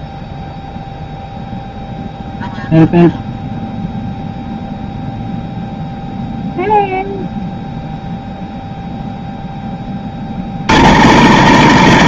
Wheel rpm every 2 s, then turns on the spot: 0, 0, 0, 0, 0, 50.
none